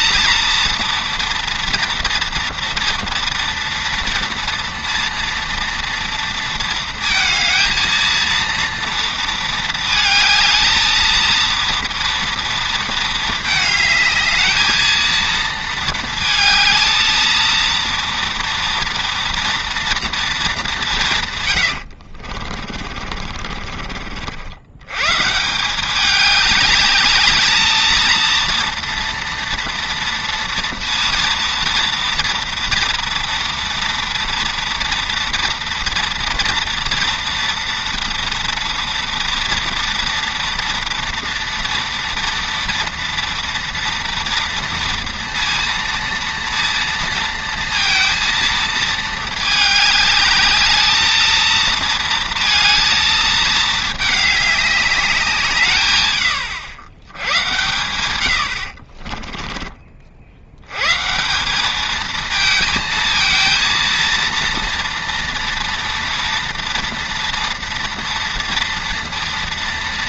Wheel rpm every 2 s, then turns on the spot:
230, 230, 230, 230, 230, 220, 230, 220, 220, 230, 200, 50, 90, 200, 230, 230, 230, 230, 230, 230, 230, 230, 230, 230, 230, 210, 230, 200, 90, 70, 100, 220, 230, 230, 230.
22-24 58-60